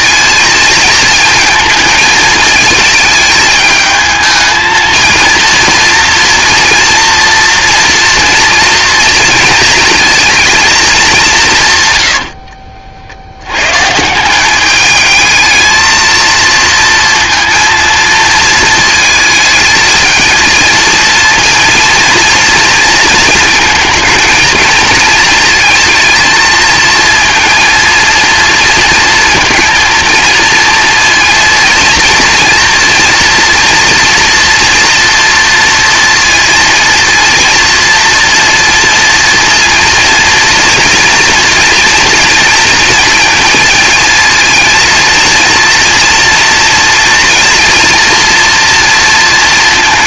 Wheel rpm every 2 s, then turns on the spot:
220, 220, 220, 230, 230, 220, 60, 210, 230, 220, 220, 230, 220, 220, 230, 230, 230, 240, 230, 230, 230, 230, 230, 230, 230.
none